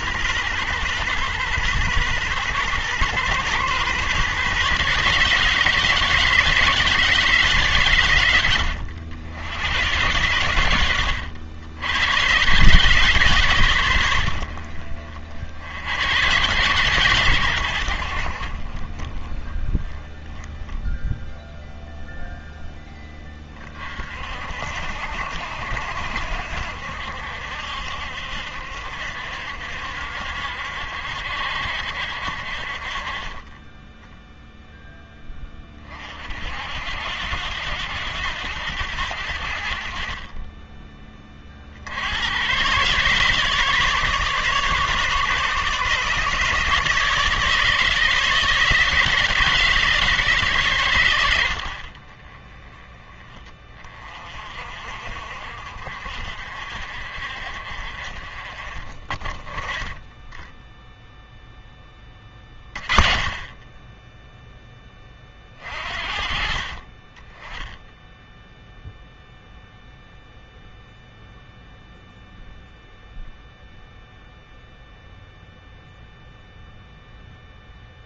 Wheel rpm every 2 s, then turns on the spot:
120, 120, 140, 150, 80, 90, 130, 50, 110, 30, 10, 10, 60, 60, 70, 60, 40, 10, 70, 90, 20, 120, 140, 150, 160, 110, 20, 50, 50, 40, 0, 30, 10, 40, 0, 0, 0, 0, 0.
none